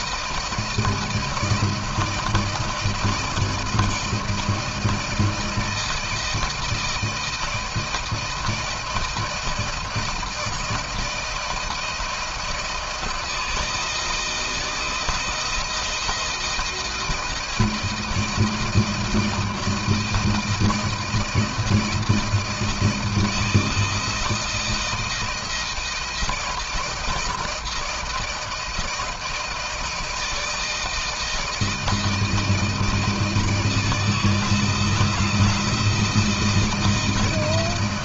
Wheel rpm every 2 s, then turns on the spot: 160, 160, 160, 160, 160, 160, 160, 160, 160, 160, 160, 160, 160, 160, 160, 160, 160, 160, 170.
none